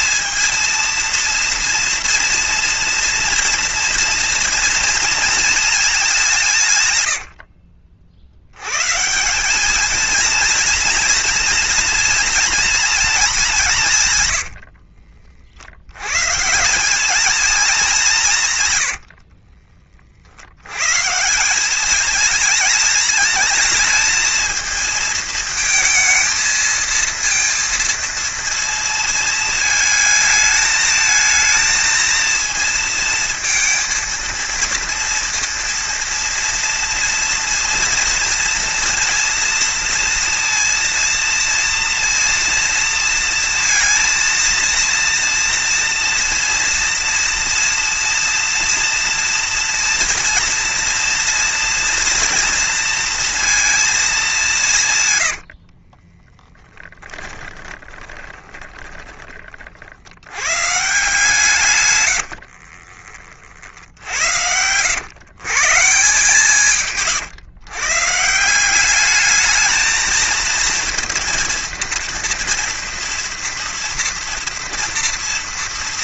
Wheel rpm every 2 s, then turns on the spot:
230, 230, 230, 120, 140, 230, 230, 70, 190, 110, 120, 220, 220, 220, 230, 220, 230, 230, 230, 230, 230, 230, 230, 230, 230, 230, 230, 150, 30, 20, 140, 40, 100, 150, 200, 230, 240, 230.
6-8 14-16 18-20 56-60 62-64 66-68